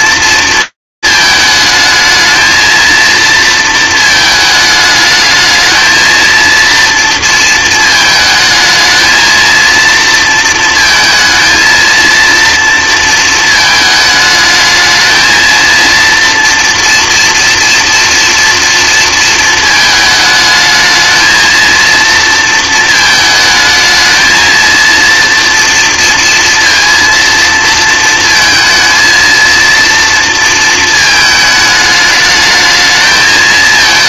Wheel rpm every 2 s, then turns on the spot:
220, 230, 210, 230, 220, 220, 230, 220, 230, 230, 220, 220, 230, 230, 230, 220, 220.
none